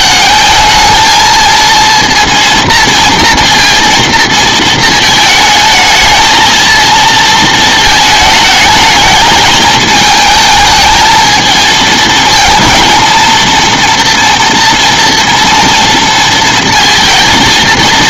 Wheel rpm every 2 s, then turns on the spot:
220, 230, 230, 220, 220, 220, 220, 230, 230.
none